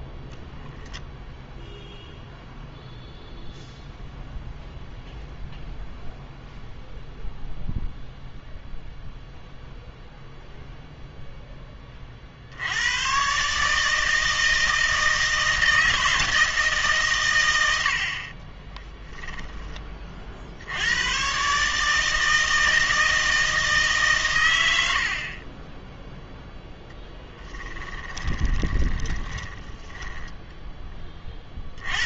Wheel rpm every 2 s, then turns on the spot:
10, 0, 0, 0, 0, 0, 90, 160, 150, 10, 80, 160, 90, 0, 30, 10.
0-2 18-20 28-30